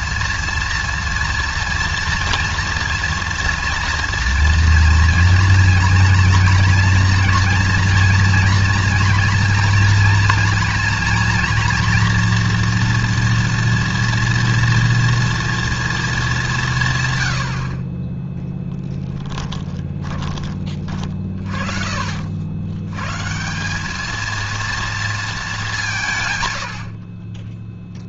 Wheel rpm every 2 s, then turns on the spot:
230, 230, 230, 230, 230, 230, 240, 230, 150, 10, 30, 90, 230, 80.
none